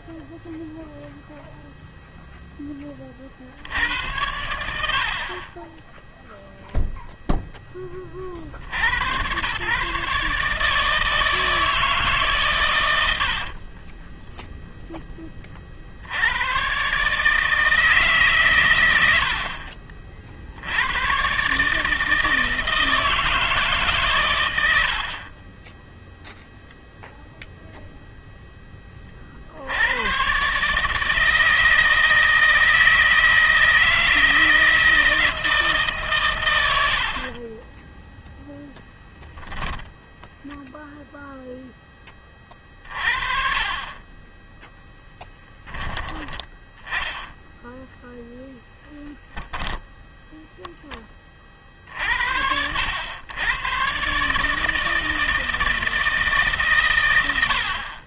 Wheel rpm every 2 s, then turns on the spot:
0, 20, 60, 0, 80, 160, 90, 10, 130, 80, 100, 160, 70, 0, 30, 150, 160, 160, 60, 10, 0, 40, 10, 20, 10, 20, 90, 160, 120.
24-26 36-38